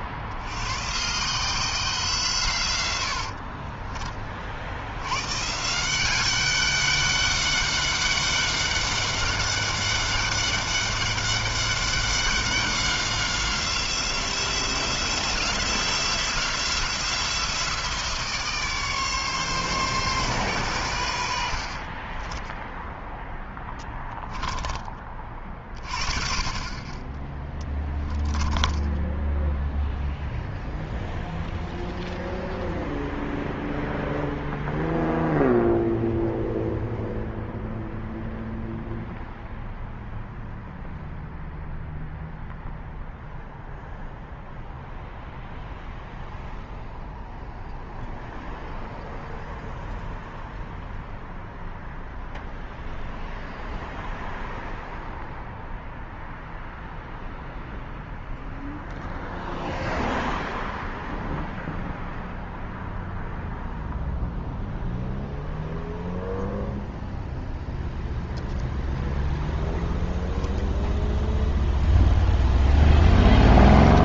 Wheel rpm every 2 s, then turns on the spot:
160, 60, 130, 200, 200, 200, 180, 170, 170, 140, 70, 10, 30, 20, 10, 0, 0, 0, 0, 0, 0, 0, 0, 0, 0, 0, 0, 0, 0, 0, 0, 0, 0, 0, 0, 0, 0.
2-4 28-30